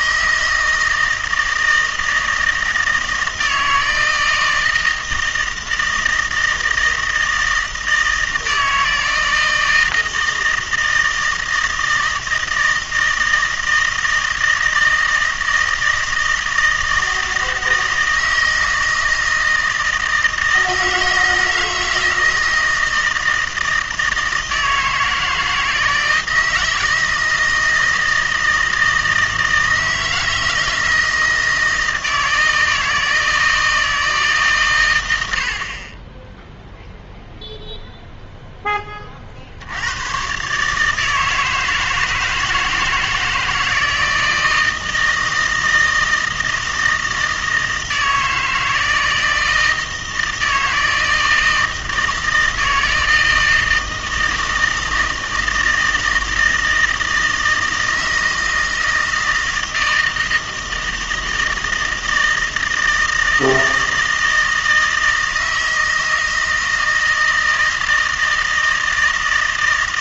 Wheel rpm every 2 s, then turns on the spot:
160, 160, 160, 160, 160, 160, 160, 160, 160, 160, 160, 160, 160, 160, 160, 160, 160, 120, 0, 20, 150, 160, 160, 160, 160, 160, 160, 160, 160, 160, 160, 160, 160, 160, 160.
none